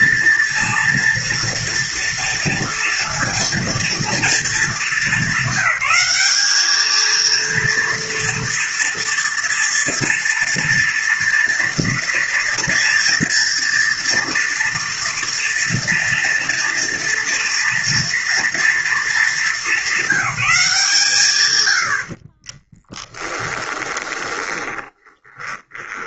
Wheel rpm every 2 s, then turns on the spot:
230, 230, 220, 210, 230, 230, 240, 240, 230, 230, 170, 20, 20.
22-26